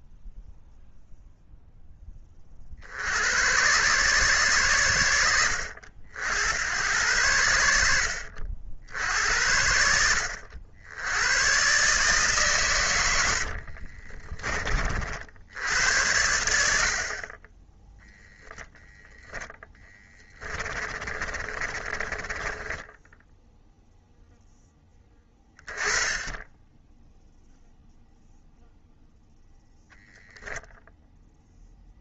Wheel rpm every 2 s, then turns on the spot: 0, 50, 120, 80, 70, 80, 130, 40, 90, 10, 20, 10, 20, 0, 0, 0.
20-24